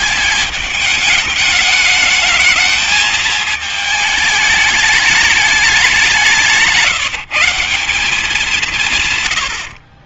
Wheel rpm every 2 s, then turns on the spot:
210, 220, 220, 180, 180.
none